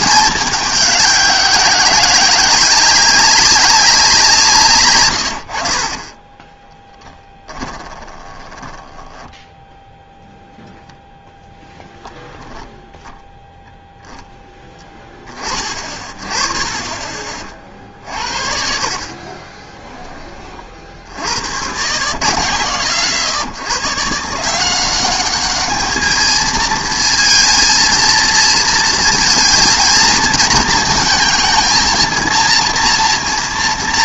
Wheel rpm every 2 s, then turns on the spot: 210, 190, 140, 10, 20, 0, 0, 10, 30, 50, 40, 90, 190, 220, 220, 220, 230.
6-10